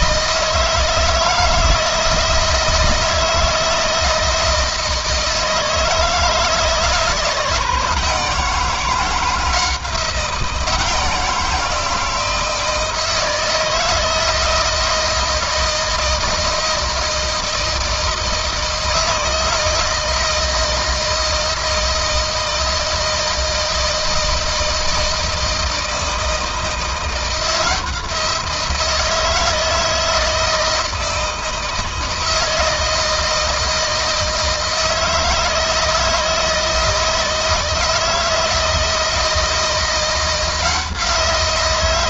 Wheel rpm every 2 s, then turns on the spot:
160, 160, 160, 160, 170, 170, 160, 160, 160, 160, 160, 160, 160, 160, 170, 160, 160, 160, 160, 160, 170.
none